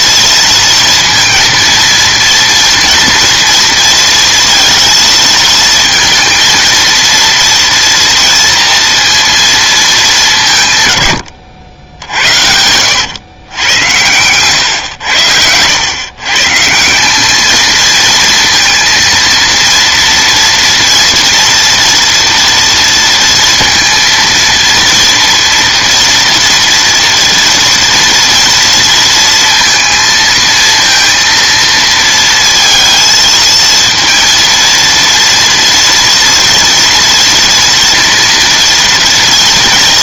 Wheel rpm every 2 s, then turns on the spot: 230, 230, 230, 230, 230, 120, 90, 100, 170, 230, 230, 230, 230, 230, 230, 230, 230, 230, 230, 230.
none